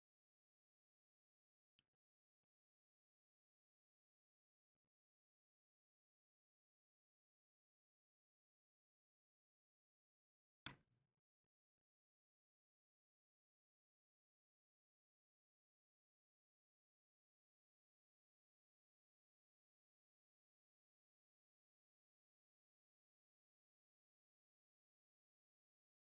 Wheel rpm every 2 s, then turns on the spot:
0, 0, 0, 0, 0, 0, 0, 0, 0, 0, 0, 0, 0.
none